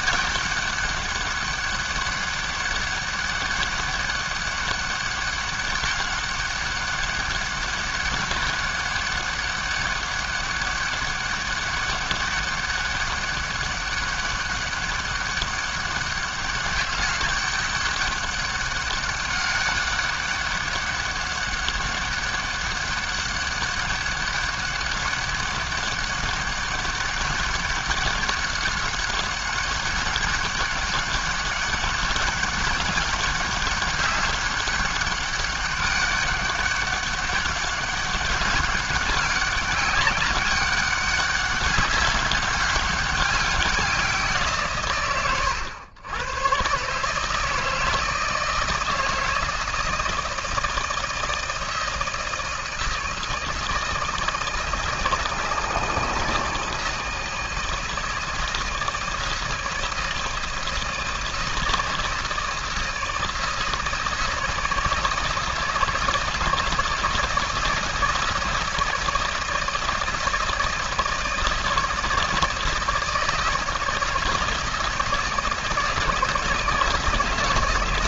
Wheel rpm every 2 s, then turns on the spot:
200, 200, 200, 200, 200, 200, 200, 200, 200, 200, 200, 200, 200, 200, 200, 200, 200, 200, 200, 200, 200, 200, 130, 130, 160, 160, 160, 160, 160, 160, 160, 160, 160, 160, 160, 160, 160, 160, 160.
none